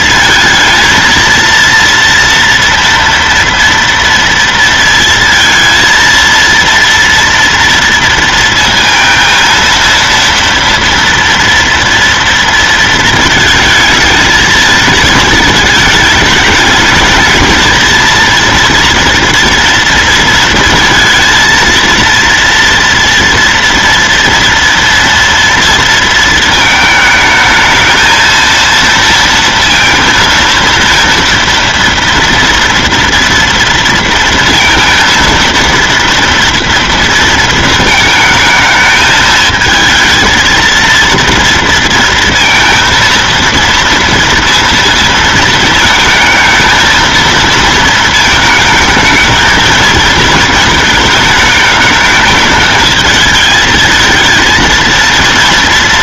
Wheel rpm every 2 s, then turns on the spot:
220, 230, 230, 230, 230, 230, 230, 220, 220, 230, 220, 230, 230, 220, 230, 230, 230, 230, 230, 220, 220, 230, 230, 220, 220, 220, 220, 230.
none